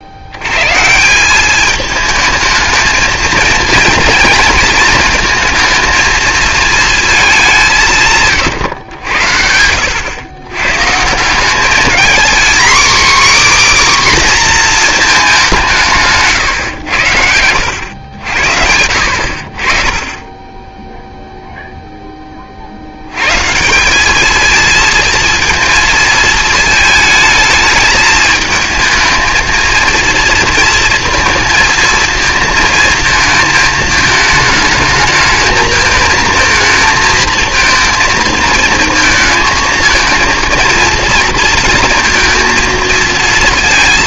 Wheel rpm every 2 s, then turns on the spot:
130, 220, 230, 220, 110, 110, 250, 240, 110, 70, 10, 50, 220, 230, 220, 230, 230, 220, 220, 220, 230, 230.
none